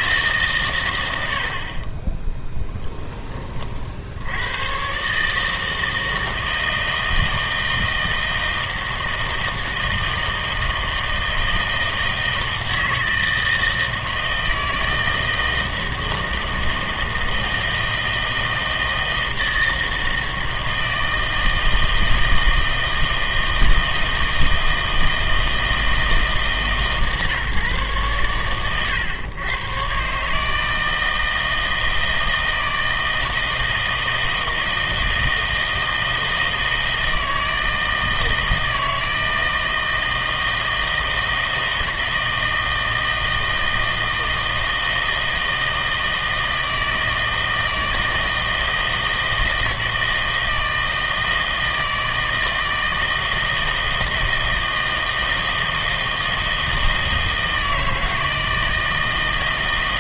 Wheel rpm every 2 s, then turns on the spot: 110, 0, 120, 160, 160, 160, 160, 160, 160, 160, 160, 160, 160, 140, 120, 160, 160, 160, 160, 160, 160, 160, 160, 160, 160, 160, 160, 160, 160, 160.
none